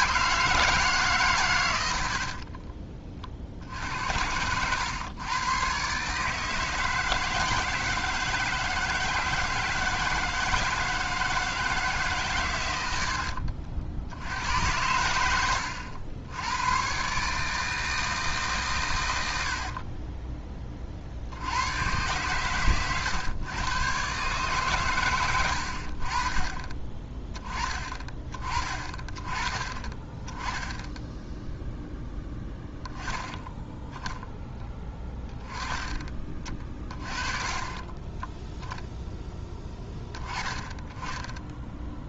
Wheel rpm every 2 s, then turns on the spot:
160, 40, 100, 160, 160, 160, 110, 100, 110, 140, 20, 120, 130, 30, 30, 10, 10, 20, 30, 0, 10.
2-4